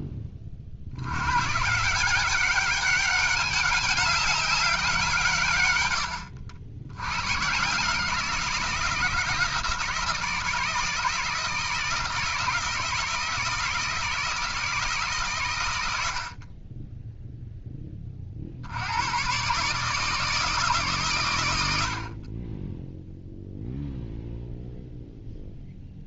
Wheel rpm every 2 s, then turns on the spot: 60, 200, 190, 80, 170, 160, 160, 160, 20, 80, 160, 10, 0.
none